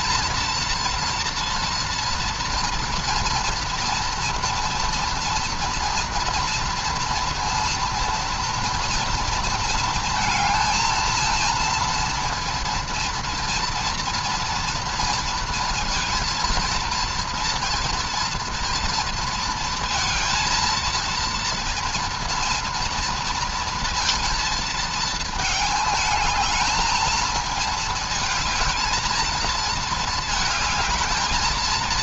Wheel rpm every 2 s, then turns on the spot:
230, 230, 230, 230, 230, 230, 230, 230, 230, 230, 230, 230, 220, 220, 230, 220.
none